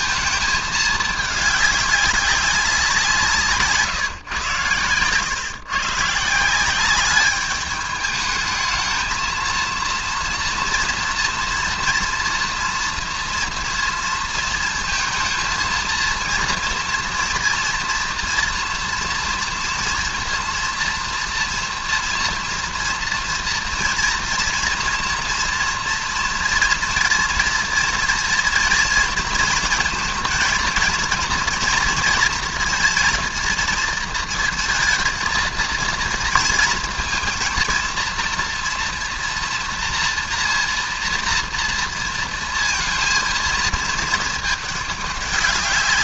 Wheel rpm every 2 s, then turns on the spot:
220, 190, 120, 170, 220, 230, 230, 230, 230, 230, 230, 230, 230, 240, 230, 230, 230, 230, 230, 230, 230, 230, 210.
none